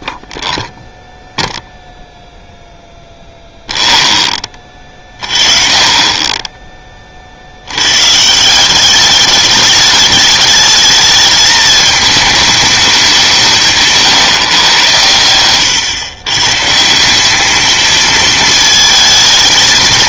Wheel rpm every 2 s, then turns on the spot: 0, 0, 30, 20, 170, 210, 210, 130, 150, 220.
none